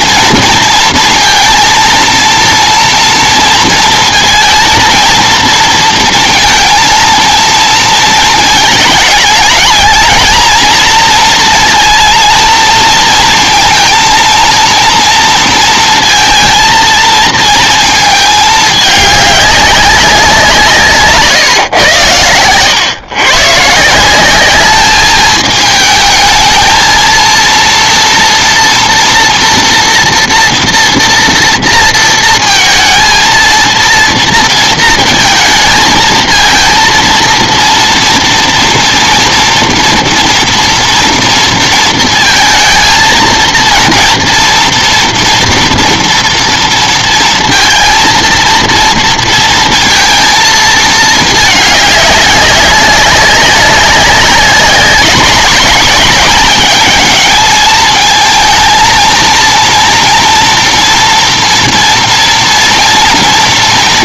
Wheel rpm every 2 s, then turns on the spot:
230, 230, 230, 230, 220, 230, 230, 230, 230, 210, 180, 110, 210, 220, 240, 240, 230, 230, 220, 230, 230, 230, 230, 230, 230, 220, 200, 200, 210, 230, 240, 240.
none